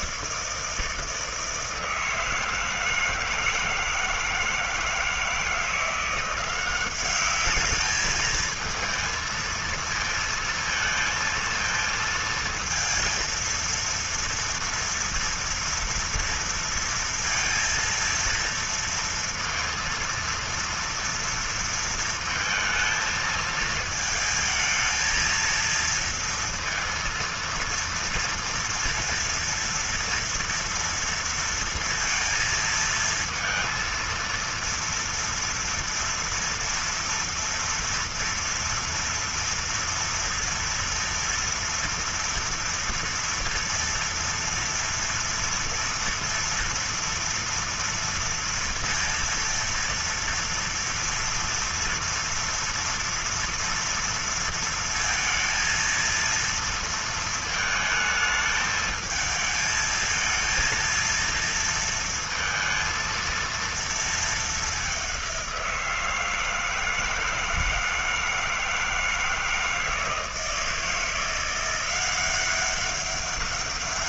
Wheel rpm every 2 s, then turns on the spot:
160, 160, 160, 180, 220, 230, 220, 230, 230, 230, 230, 230, 220, 230, 230, 230, 230, 230, 230, 230, 230, 230, 230, 230, 230, 230, 230, 230, 230, 220, 230, 230, 210, 160, 160, 160, 190.
none